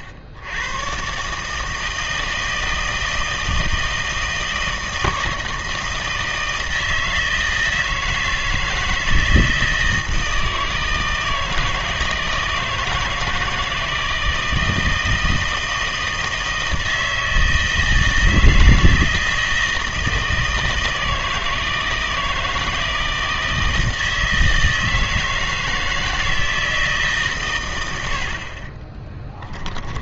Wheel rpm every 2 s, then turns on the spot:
90, 160, 160, 160, 160, 160, 160, 160, 160, 160, 160, 160, 160, 160, 40.
28-30